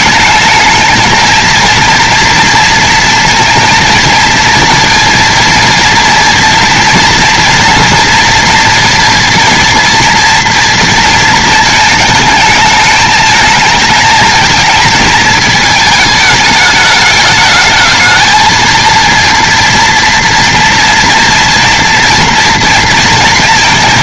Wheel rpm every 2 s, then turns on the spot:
210, 230, 230, 230, 230, 230, 220, 220, 210, 220, 230, 230.
none